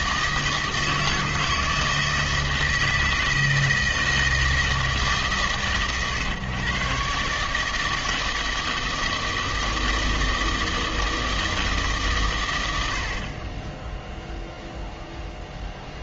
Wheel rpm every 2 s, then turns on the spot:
160, 160, 160, 130, 160, 160, 90, 0.
none